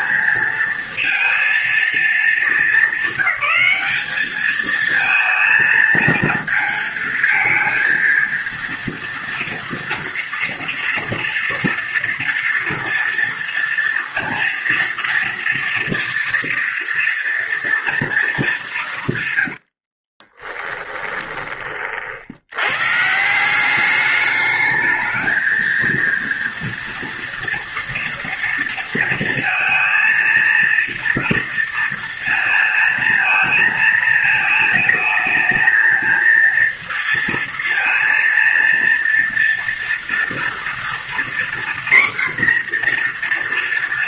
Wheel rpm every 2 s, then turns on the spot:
230, 220, 220, 230, 230, 230, 230, 230, 230, 190, 20, 100, 210, 230, 230, 230, 230, 220, 230, 230, 240, 250.
20-22